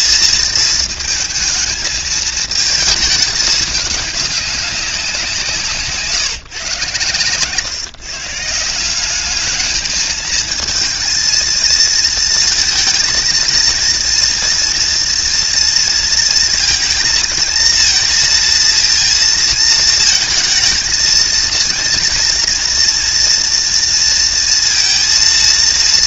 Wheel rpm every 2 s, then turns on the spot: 220, 220, 180, 120, 180, 230, 230, 230, 230, 230, 230, 230, 230.
none